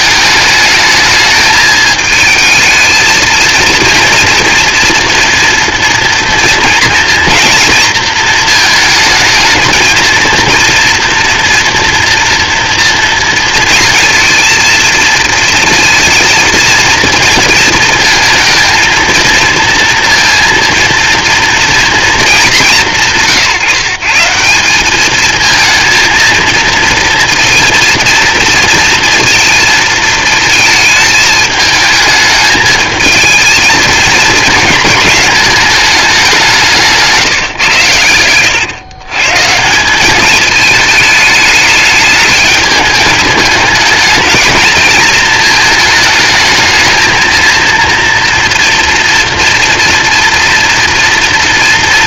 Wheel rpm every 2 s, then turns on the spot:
210, 220, 230, 230, 220, 230, 230, 230, 230, 230, 230, 170, 190, 230, 230, 220, 220, 220, 170, 120, 220, 210, 220, 220, 230, 230.
none